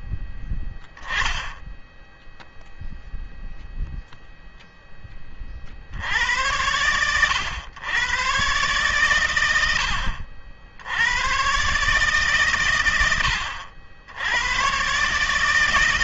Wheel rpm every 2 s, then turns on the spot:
0, 0, 0, 90, 130, 80, 120, 100.
none